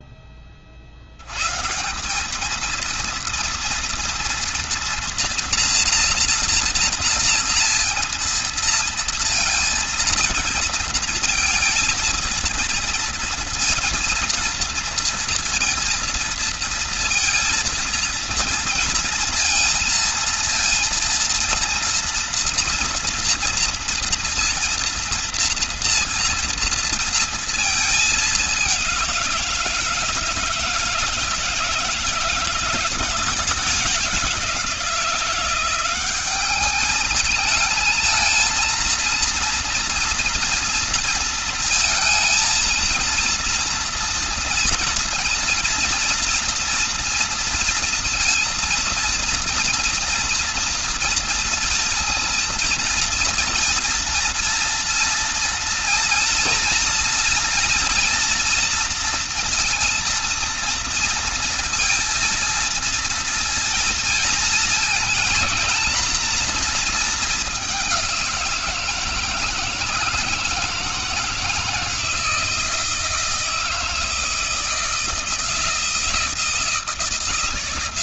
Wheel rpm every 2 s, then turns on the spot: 30, 210, 230, 230, 230, 230, 230, 230, 230, 230, 230, 230, 230, 230, 200, 160, 170, 170, 200, 230, 230, 230, 230, 230, 230, 230, 230, 230, 230, 230, 230, 230, 230, 230, 170, 160, 160, 160, 160.
none